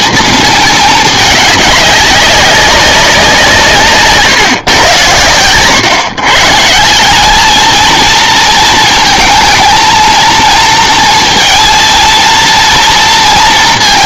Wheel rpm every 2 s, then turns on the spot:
220, 200, 120, 160, 220, 230, 230.
none